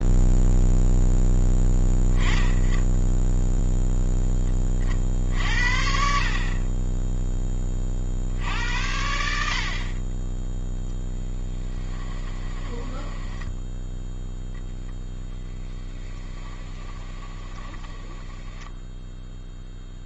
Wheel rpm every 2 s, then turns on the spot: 0, 10, 20, 30, 80, 10, 20, 0, 20, 10.
12-14 16-20